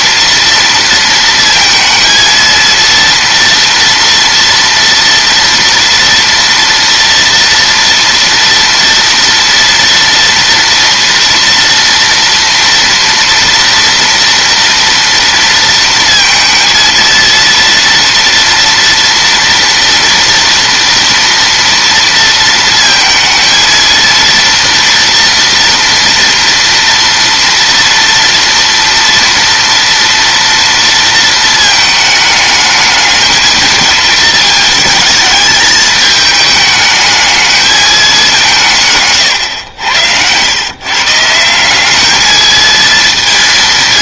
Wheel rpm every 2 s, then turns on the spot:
230, 230, 230, 230, 230, 230, 230, 240, 230, 240, 230, 230, 230, 230, 230, 230, 210, 220, 210, 160, 120, 220.
none